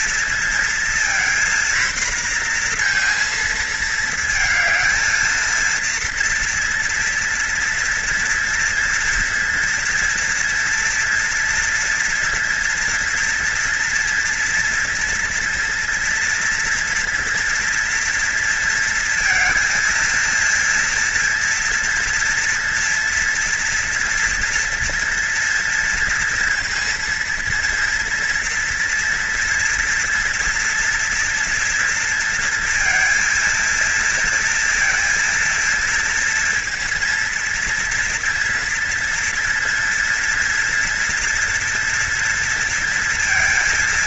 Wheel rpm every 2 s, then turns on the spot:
230, 240, 220, 230, 230, 230, 230, 230, 230, 230, 230, 230, 230, 230, 230, 230, 230, 230, 230, 230, 240, 230.
none